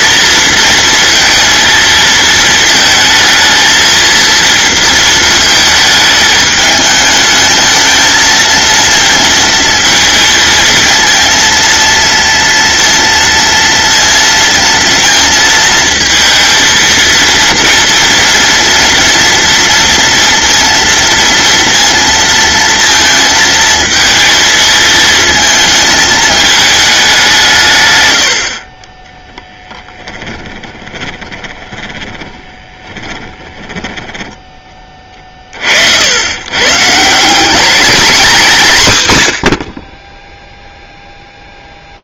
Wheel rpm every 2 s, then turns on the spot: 220, 230, 220, 220, 220, 220, 230, 230, 230, 230, 230, 230, 230, 220, 170, 10, 20, 20, 30, 190, 110.
30-36